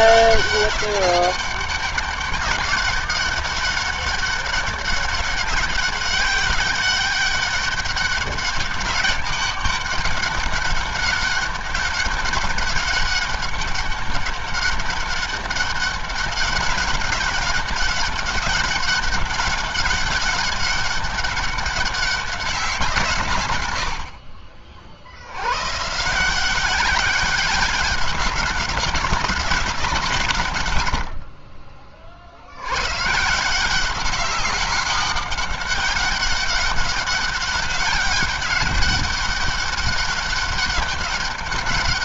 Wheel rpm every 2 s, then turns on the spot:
190, 190, 200, 200, 190, 200, 190, 200, 200, 190, 190, 170, 60, 190, 190, 110, 110, 190, 200, 200, 200.
none